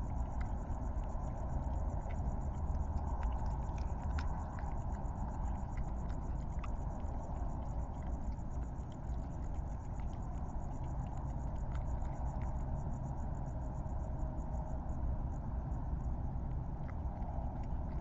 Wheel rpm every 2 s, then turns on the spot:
0, 0, 0, 0, 0, 0, 0, 0, 0.
none